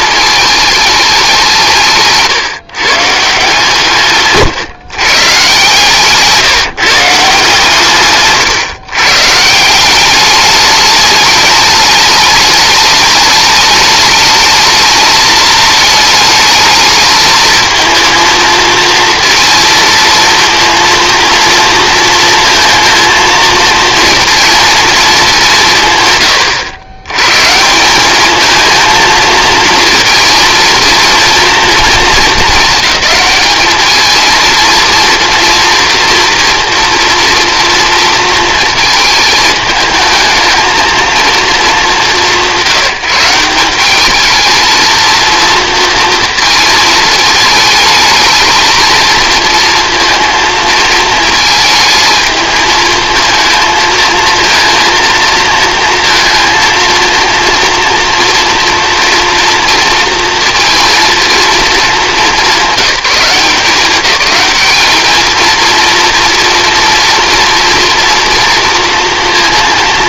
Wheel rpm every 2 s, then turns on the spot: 220, 150, 130, 160, 140, 210, 210, 210, 210, 230, 230, 230, 230, 100, 210, 230, 210, 230, 230, 230, 220, 190, 220, 220, 220, 230, 220, 230, 230, 230, 230, 200, 210, 230, 230.
4-6